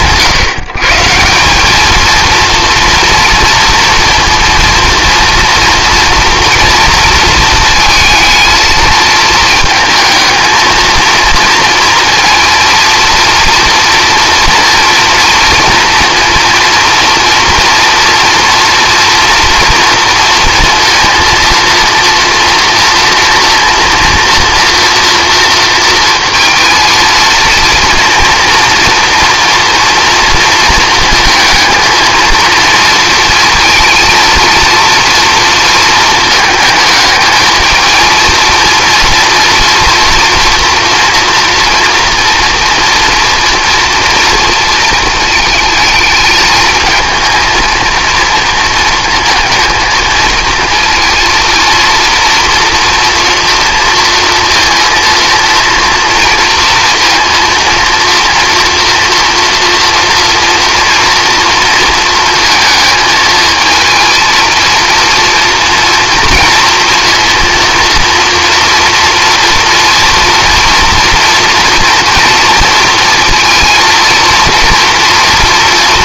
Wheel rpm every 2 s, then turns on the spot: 160, 230, 230, 230, 220, 220, 230, 230, 230, 230, 230, 230, 230, 220, 230, 230, 230, 230, 220, 230, 230, 230, 230, 220, 230, 230, 240, 230, 230, 230, 230, 220, 230, 230, 230, 230, 230, 230.
none